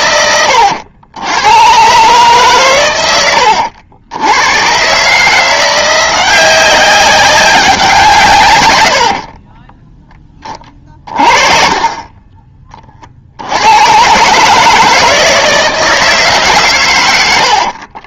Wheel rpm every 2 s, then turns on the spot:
90, 130, 110, 190, 110, 30, 30, 150, 140.
none